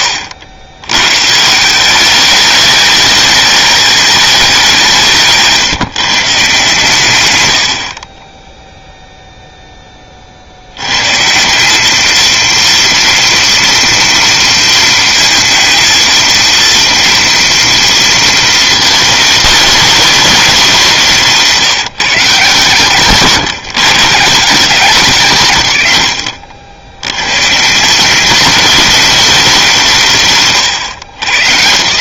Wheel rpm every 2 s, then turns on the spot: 100, 210, 180, 140, 0, 80, 230, 230, 230, 220, 180, 120, 180, 50, 220, 120.
4-6 30-32